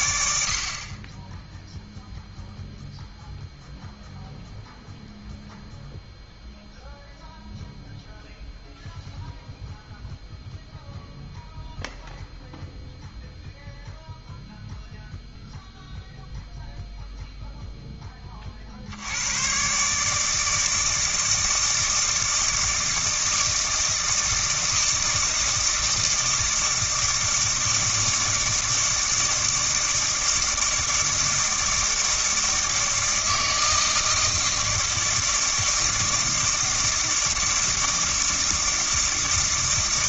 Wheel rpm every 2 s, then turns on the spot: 40, 0, 0, 0, 0, 0, 0, 0, 0, 70, 160, 160, 160, 160, 160, 160, 160, 160, 160, 160.
none